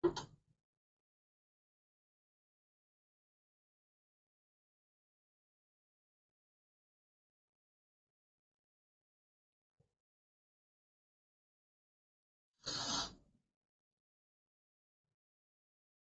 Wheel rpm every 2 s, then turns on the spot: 0, 0, 0, 0, 0, 0, 0, 0.
none